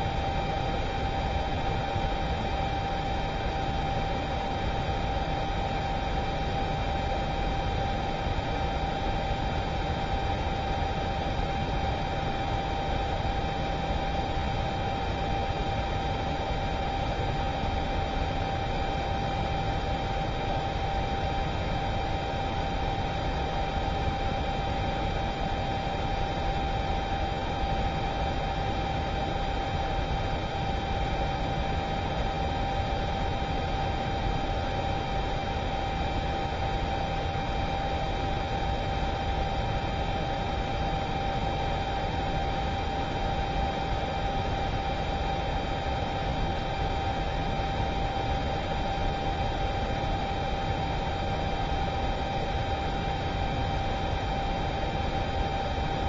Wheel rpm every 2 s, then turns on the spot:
0, 0, 0, 0, 0, 0, 0, 0, 0, 0, 0, 0, 0, 0, 0, 0, 0, 0, 0, 0, 0, 0, 0, 0, 0, 0, 0, 0.
none